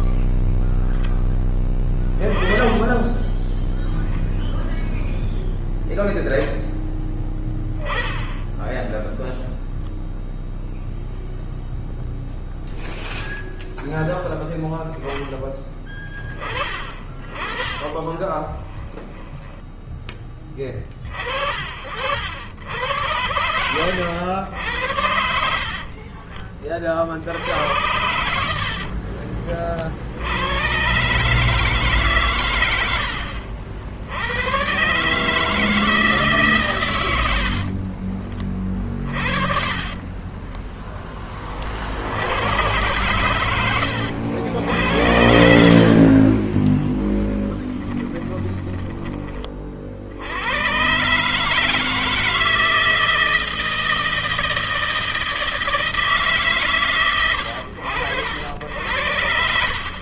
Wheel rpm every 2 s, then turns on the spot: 0, 10, 0, 10, 10, 0, 0, 0, 20, 10, 30, 80, 80, 50, 60, 110, 100, 130, 120, 30, 10, 110, 80, 20, 10, 120, 160, 160, 130, 100.
2-4 18-20 28-30 38-40 44-48